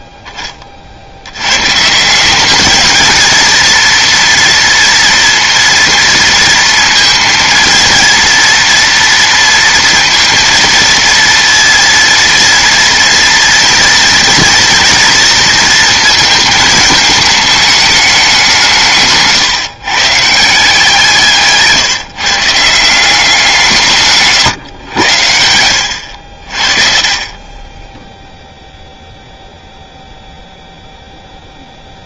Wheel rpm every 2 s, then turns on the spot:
30, 210, 230, 230, 230, 230, 230, 230, 220, 180, 150, 160, 110, 40, 0, 0.
none